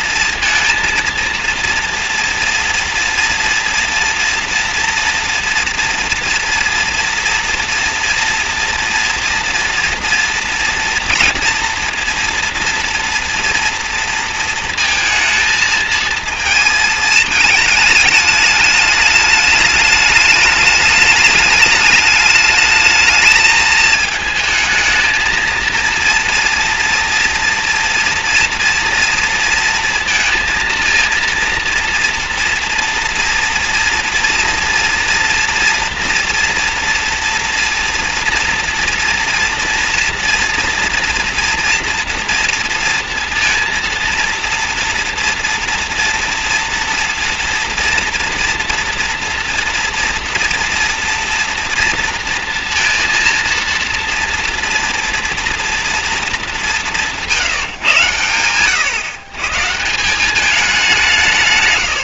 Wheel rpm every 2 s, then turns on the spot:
230, 230, 230, 230, 230, 230, 230, 230, 220, 210, 210, 220, 220, 230, 230, 230, 230, 230, 230, 230, 230, 240, 230, 230, 230, 230, 230, 230, 190, 120, 200.
none